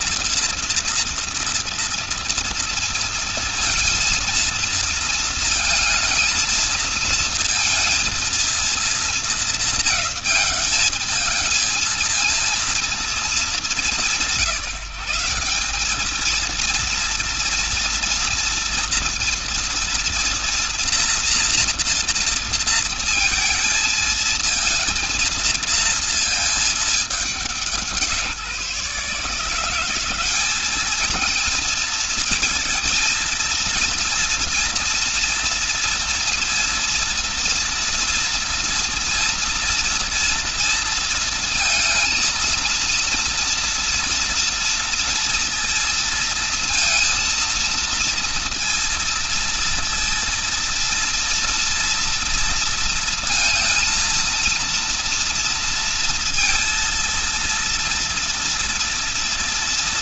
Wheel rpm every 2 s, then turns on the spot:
230, 230, 230, 230, 230, 220, 230, 180, 230, 230, 240, 230, 230, 220, 160, 200, 230, 230, 230, 230, 230, 230, 230, 230, 230, 230, 230, 230, 230, 230.
none